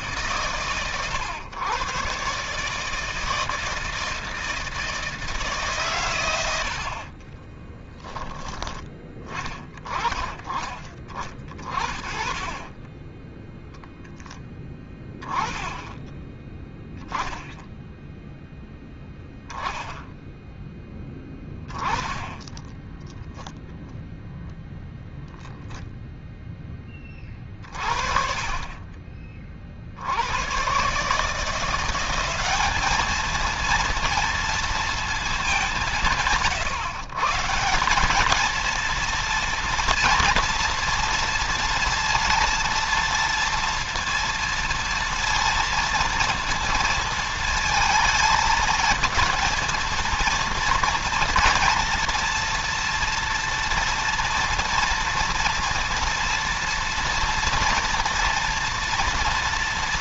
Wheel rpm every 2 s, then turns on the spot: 130, 150, 160, 60, 10, 20, 10, 10, 10, 10, 10, 10, 0, 20, 30, 120, 210, 230, 140, 230, 230, 230, 230, 230, 220, 230, 230, 230, 230, 230.
6-8 22-24